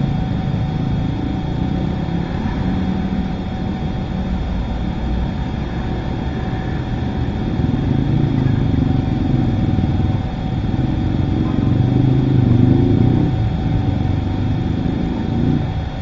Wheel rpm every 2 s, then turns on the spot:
0, 0, 0, 0, 0, 0, 0, 0.
none